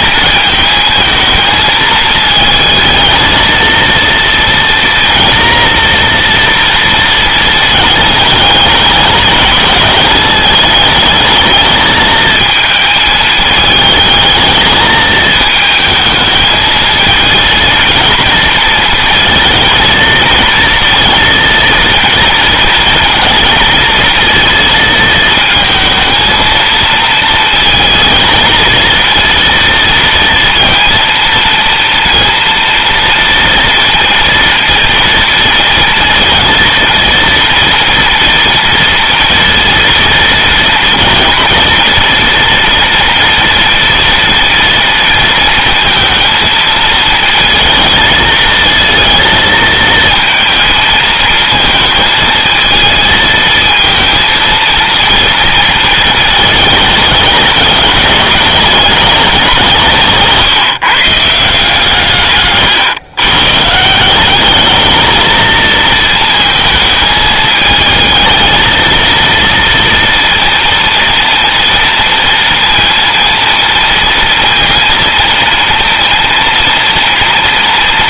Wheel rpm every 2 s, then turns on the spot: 220, 220, 230, 230, 210, 220, 220, 220, 230, 230, 230, 230, 220, 230, 230, 230, 230, 230, 230, 230, 230, 230, 230, 230, 230, 220, 220, 230, 210, 210, 150, 120, 220, 220, 230, 230, 230, 230, 230.
none